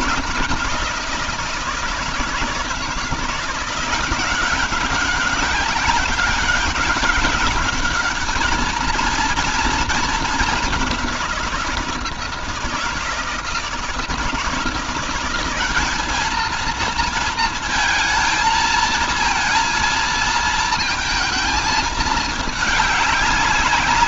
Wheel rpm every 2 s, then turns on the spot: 180, 160, 190, 200, 220, 200, 160, 170, 220, 220, 220, 210.
none